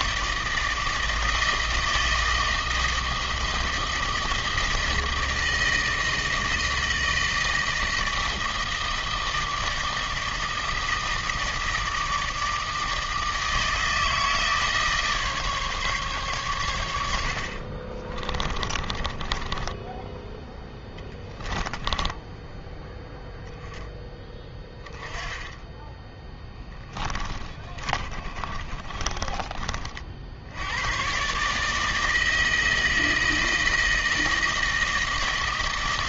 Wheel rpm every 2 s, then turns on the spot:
160, 160, 160, 160, 160, 160, 160, 160, 110, 30, 10, 10, 20, 20, 30, 90, 160, 160.
18-20 26-30